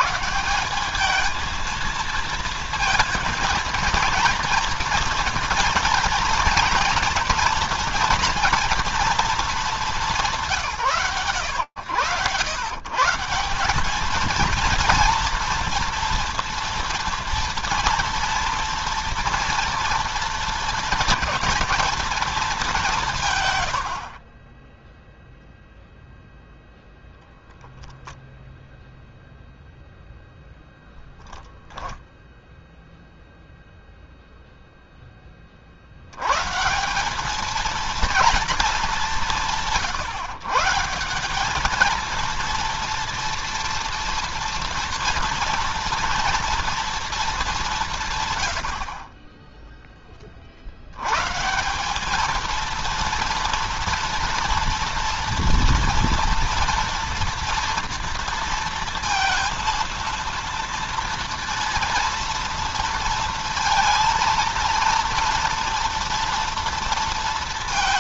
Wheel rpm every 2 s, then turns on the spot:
210, 230, 230, 240, 230, 100, 150, 230, 230, 230, 220, 170, 0, 0, 0, 0, 0, 0, 170, 210, 160, 230, 230, 230, 80, 70, 230, 230, 230, 230, 230, 230, 230, 230.
none